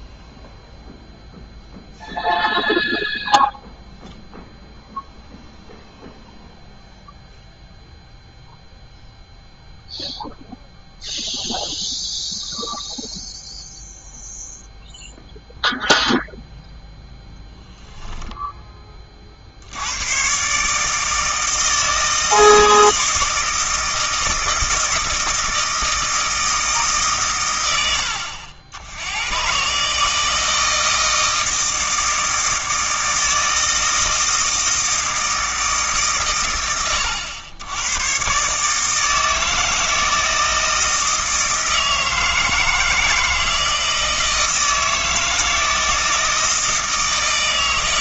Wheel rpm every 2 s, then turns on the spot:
0, 0, 0, 0, 0, 0, 0, 0, 0, 10, 140, 160, 160, 150, 80, 160, 160, 160, 110, 150, 160, 160, 160, 160.
none